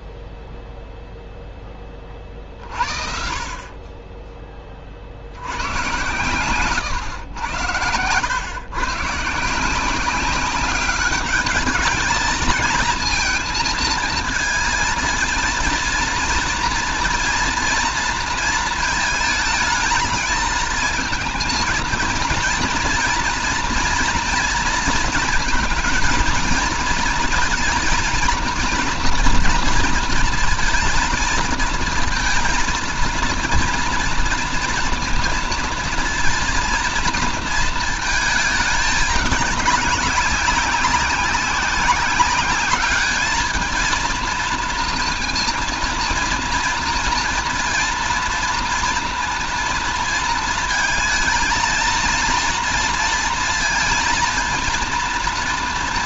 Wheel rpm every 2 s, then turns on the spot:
0, 50, 30, 120, 120, 200, 220, 220, 230, 230, 220, 230, 230, 230, 240, 220, 230, 230, 240, 210, 200, 200, 230, 230, 230, 230, 230, 230.
6-8